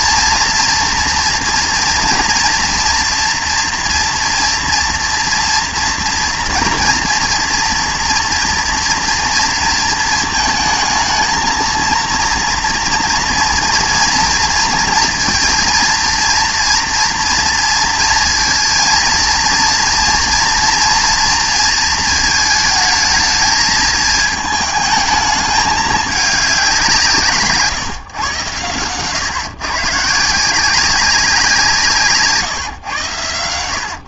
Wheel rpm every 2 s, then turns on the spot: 240, 240, 230, 230, 230, 220, 230, 230, 230, 230, 230, 220, 220, 190, 110, 170, 150.
none